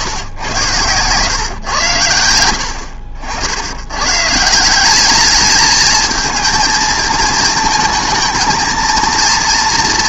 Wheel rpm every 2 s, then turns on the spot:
120, 70, 180, 230, 230.
none